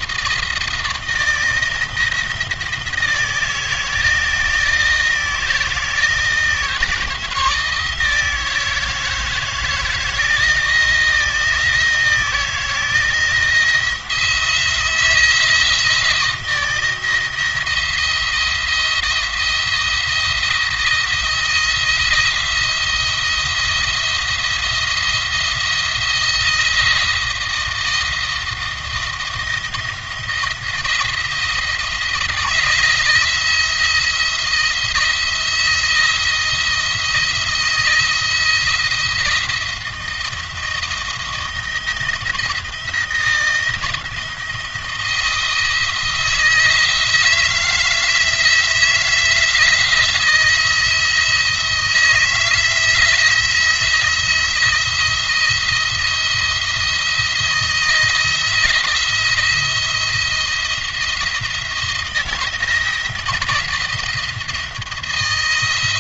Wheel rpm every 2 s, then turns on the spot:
160, 160, 170, 160, 160, 160, 170, 170, 160, 170, 170, 170, 170, 170, 170, 170, 170, 170, 170, 170, 170, 170, 160, 160, 170, 160, 170, 170, 170, 170, 170, 170, 170.
none